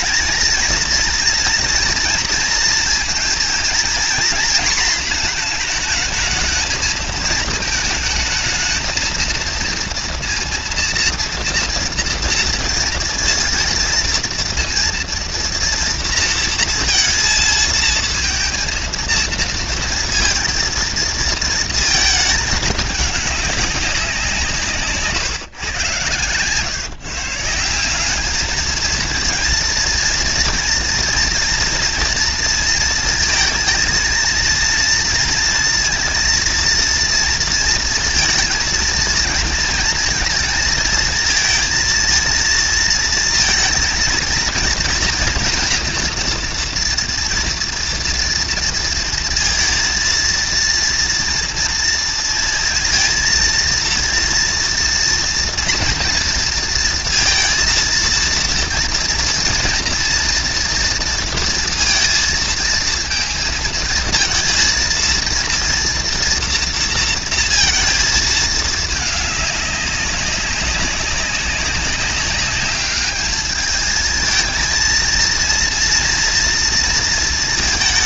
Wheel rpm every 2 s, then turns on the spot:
230, 230, 230, 230, 220, 230, 230, 230, 230, 230, 230, 220, 200, 120, 180, 230, 230, 230, 230, 230, 230, 230, 230, 240, 230, 230, 230, 230, 230, 230, 230, 230, 230, 240, 230, 200, 200, 220, 230.
none